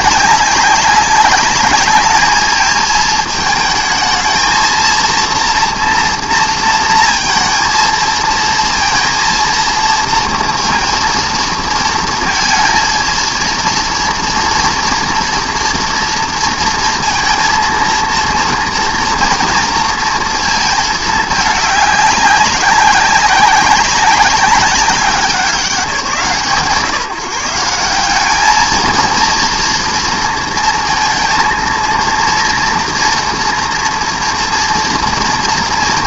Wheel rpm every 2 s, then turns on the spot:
200, 220, 230, 230, 230, 230, 230, 240, 230, 230, 220, 200, 190, 160, 220, 230, 230, 230.
none